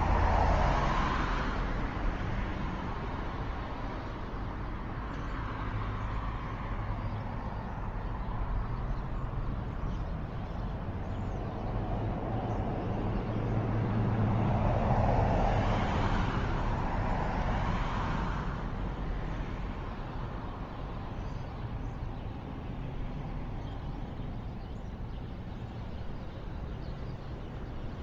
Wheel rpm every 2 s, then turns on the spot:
0, 0, 0, 0, 0, 0, 0, 0, 0, 0, 0, 0, 0, 0.
none